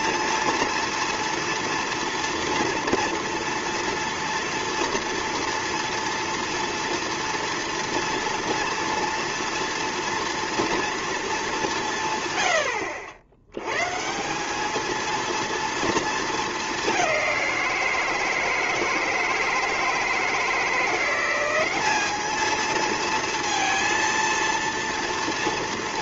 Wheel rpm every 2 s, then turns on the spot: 230, 240, 230, 230, 230, 230, 90, 210, 210, 160, 170, 220, 230.
12-14